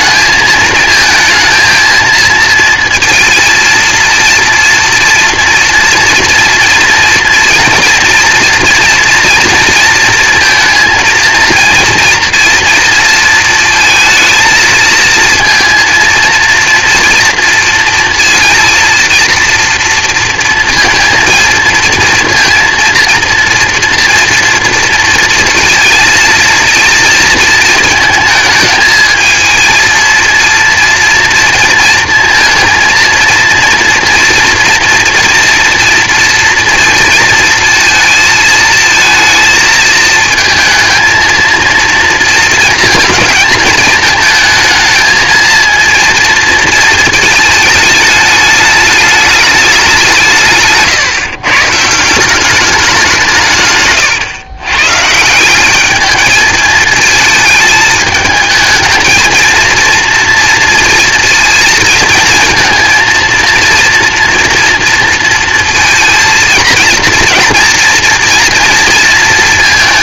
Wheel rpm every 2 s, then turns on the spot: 220, 230, 230, 230, 230, 230, 230, 220, 230, 230, 230, 230, 230, 220, 220, 230, 230, 230, 230, 230, 230, 220, 220, 230, 210, 160, 190, 130, 220, 220, 230, 230, 230, 230, 230.
none